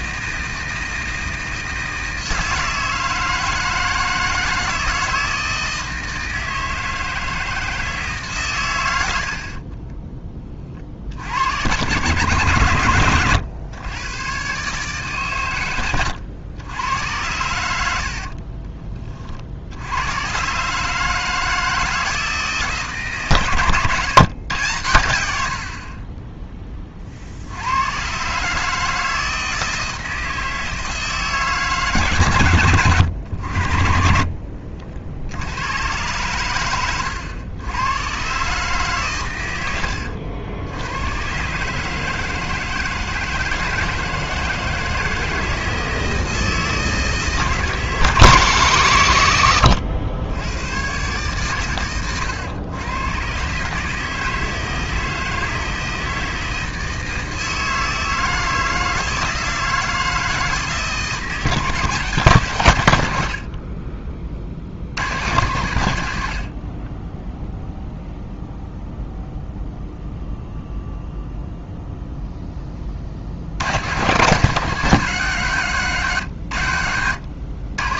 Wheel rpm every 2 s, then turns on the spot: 160, 160, 160, 160, 110, 40, 120, 140, 100, 40, 140, 160, 120, 20, 150, 160, 110, 50, 100, 140, 90, 160, 160, 160, 130, 110, 120, 160, 160, 160, 160, 130, 80, 50, 0, 0, 20, 180, 90.
18-20